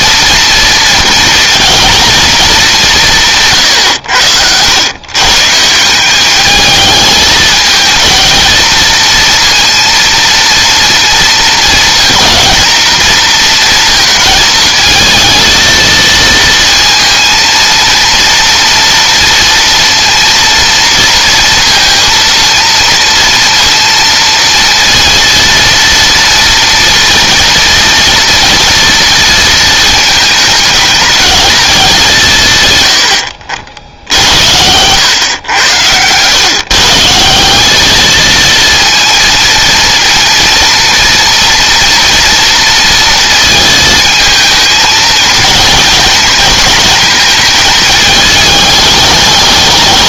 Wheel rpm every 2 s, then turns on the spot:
230, 170, 130, 210, 230, 230, 230, 220, 230, 230, 230, 230, 230, 230, 230, 220, 90, 110, 170, 230, 240, 230, 220, 220, 210.
none